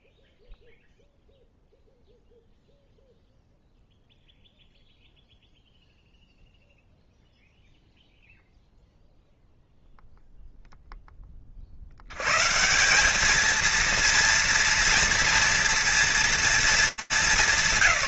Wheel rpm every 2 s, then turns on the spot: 0, 0, 0, 0, 0, 0, 160, 230, 230.
none